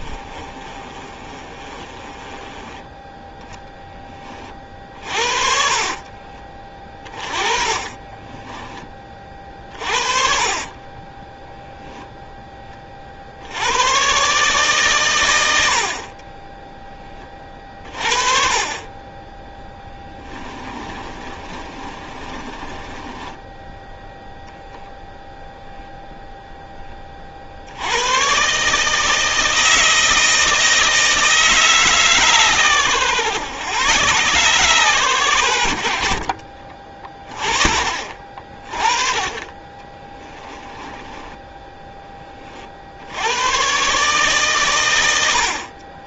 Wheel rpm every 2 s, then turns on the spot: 30, 20, 40, 20, 20, 30, 20, 140, 10, 30, 20, 20, 10, 10, 140, 160, 130, 130, 40, 30, 20, 50, 130.
0-8 10-12 20-26 40-42